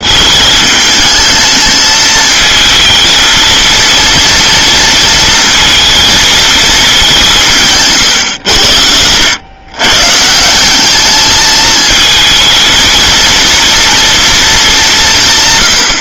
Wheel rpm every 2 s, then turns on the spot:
220, 230, 230, 210, 90, 200, 220, 220.
none